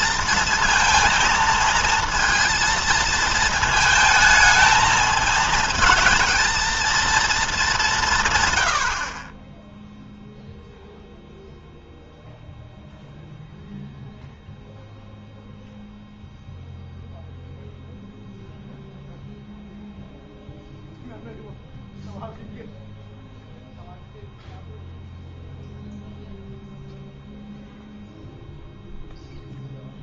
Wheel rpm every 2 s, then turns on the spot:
230, 230, 220, 220, 100, 0, 0, 0, 0, 0, 0, 0, 0, 0, 0.
none